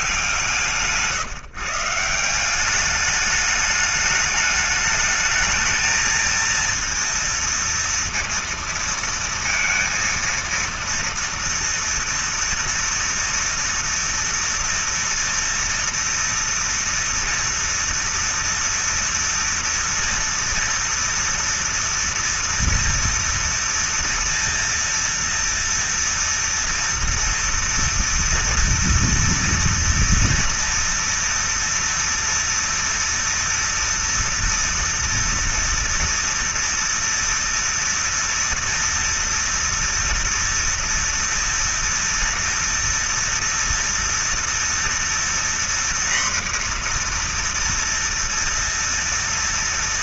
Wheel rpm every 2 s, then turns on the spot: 160, 170, 210, 230, 230, 230, 230, 230, 240, 230, 230, 230, 230, 230, 240, 230, 230, 230, 230, 230, 230, 230, 230, 240, 230.
none